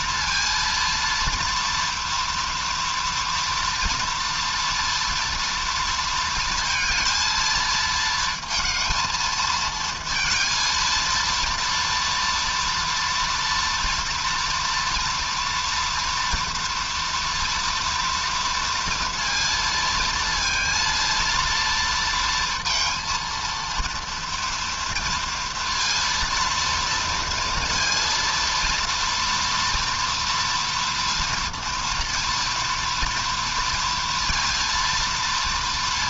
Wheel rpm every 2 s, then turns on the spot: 230, 230, 230, 230, 230, 230, 230, 230, 230, 230, 230, 230, 230, 230, 230, 230, 230, 230.
none